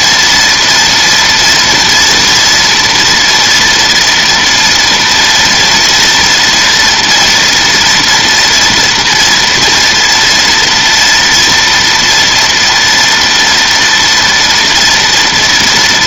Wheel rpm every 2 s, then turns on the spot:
230, 230, 230, 240, 230, 230, 230, 230.
none